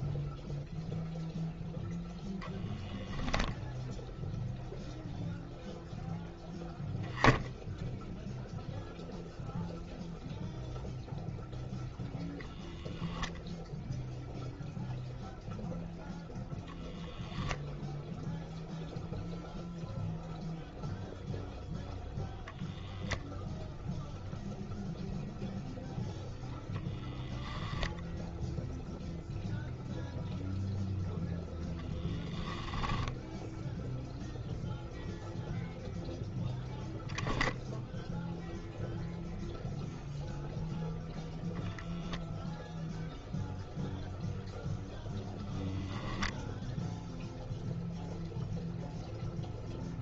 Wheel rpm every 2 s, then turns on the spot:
0, 10, 0, 0, 0, 0, 0, 0, 0, 0, 0, 0, 0, 0, 0, 0, 10, 0, 0, 0, 0, 0, 0, 0, 0.
32-34